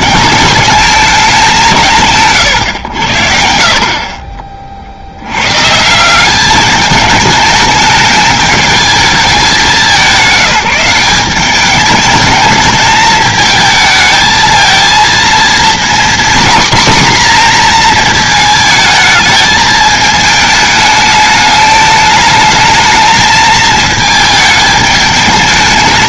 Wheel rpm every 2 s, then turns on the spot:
210, 120, 40, 200, 210, 180, 220, 220, 250, 220, 210, 220, 220.
none